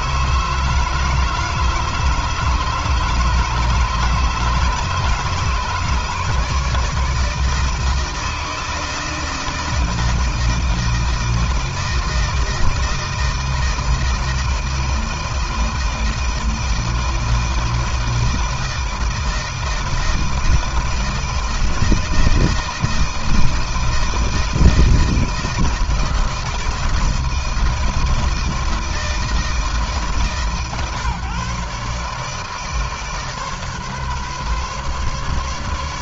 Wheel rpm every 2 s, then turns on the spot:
160, 160, 150, 150, 160, 160, 160, 160, 160, 160, 160, 160, 160, 160, 160, 150, 150, 140.
none